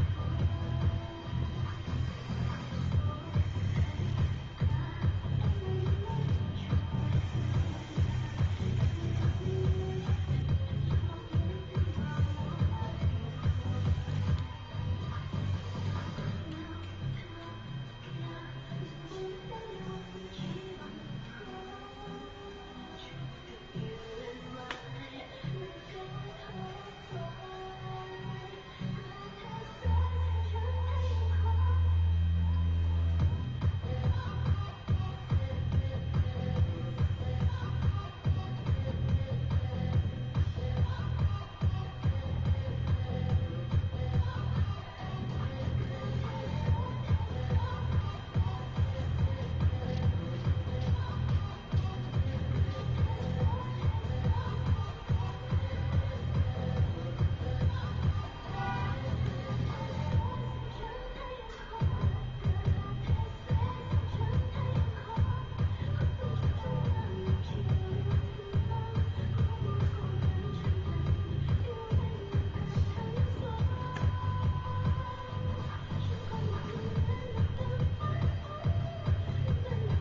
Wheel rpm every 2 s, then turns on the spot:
0, 0, 0, 0, 0, 0, 0, 0, 0, 0, 0, 0, 0, 0, 0, 0, 0, 0, 0, 0, 0, 0, 0, 0, 0, 0, 0, 0, 0, 0, 0, 0, 0, 0, 0, 0, 0, 0, 0, 0.
none